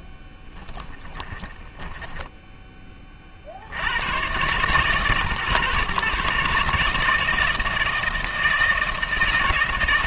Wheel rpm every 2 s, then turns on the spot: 10, 10, 120, 150, 160.
0-2